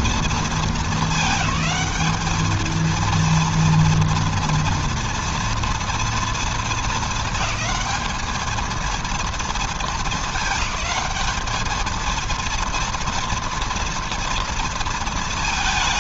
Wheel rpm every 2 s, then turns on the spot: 220, 210, 230, 220, 220, 210, 230, 230.
none